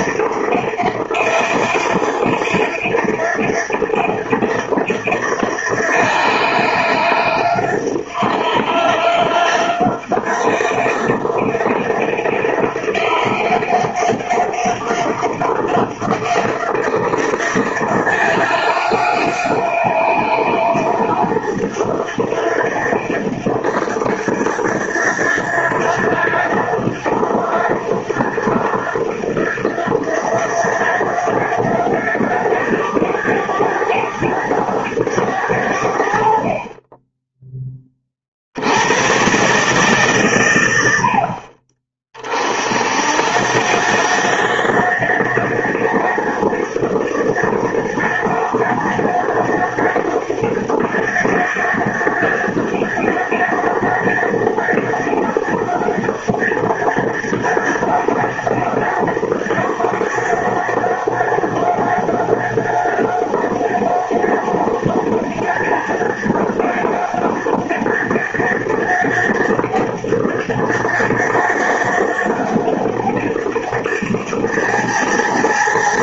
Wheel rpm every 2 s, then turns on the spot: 90, 90, 90, 90, 90, 90, 90, 90, 90, 90, 90, 90, 90, 90, 90, 90, 100, 100, 50, 80, 100, 50, 90, 100, 100, 100, 100, 100, 100, 100, 90, 90, 90, 90, 100, 100, 100, 100.
none